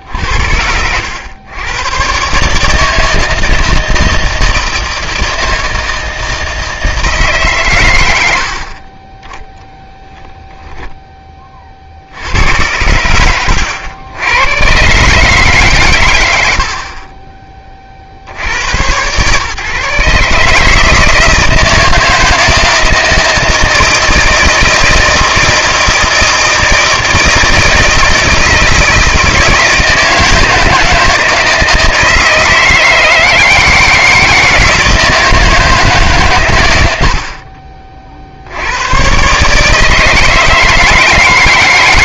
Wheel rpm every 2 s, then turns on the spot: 80, 150, 160, 160, 70, 0, 90, 110, 60, 90, 150, 160, 160, 160, 160, 160, 160, 160, 100, 90, 160.
none